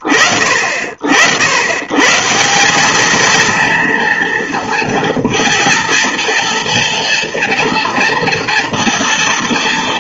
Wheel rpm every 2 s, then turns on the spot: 80, 220, 230, 230, 230.
none